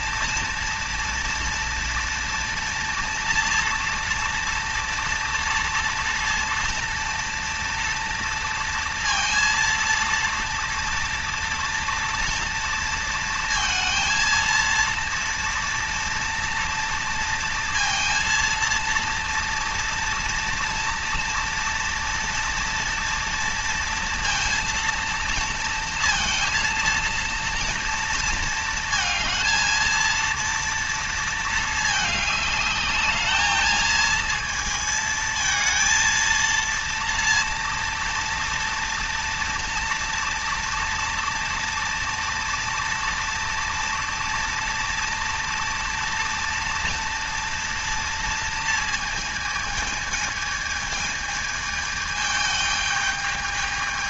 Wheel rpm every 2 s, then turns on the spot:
240, 230, 230, 230, 230, 230, 230, 230, 230, 230, 230, 230, 230, 230, 220, 230, 210, 220, 230, 240, 230, 230, 230, 230, 220, 220, 210.
none